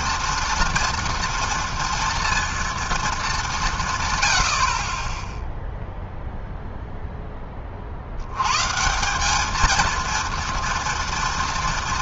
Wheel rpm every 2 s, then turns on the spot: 230, 230, 70, 0, 120, 230.
none